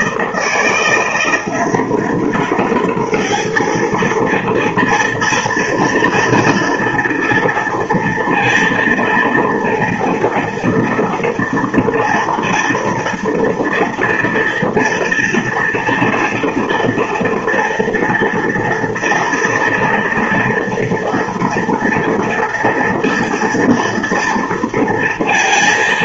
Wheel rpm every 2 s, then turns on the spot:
170, 210, 230, 230, 230, 230, 230, 230, 230, 240, 230, 230, 230.
none